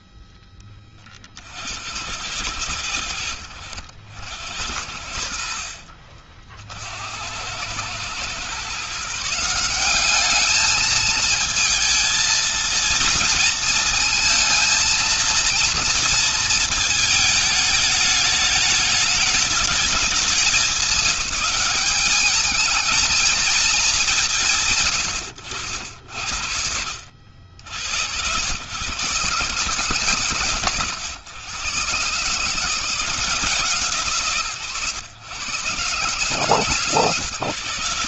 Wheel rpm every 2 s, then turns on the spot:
20, 90, 70, 60, 130, 210, 230, 230, 220, 210, 200, 210, 150, 70, 90, 110, 130, 110, 120.
none